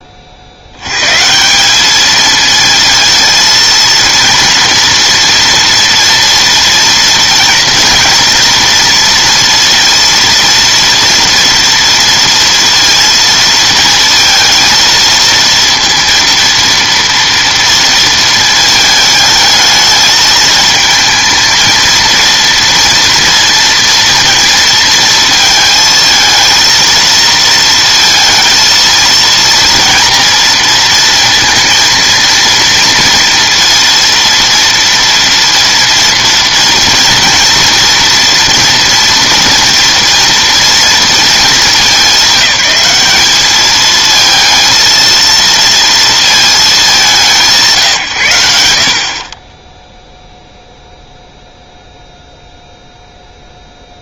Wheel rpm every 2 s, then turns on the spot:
70, 220, 230, 230, 230, 230, 230, 230, 230, 220, 220, 230, 230, 220, 230, 230, 230, 230, 230, 230, 230, 190, 230, 220, 80, 0, 0.
none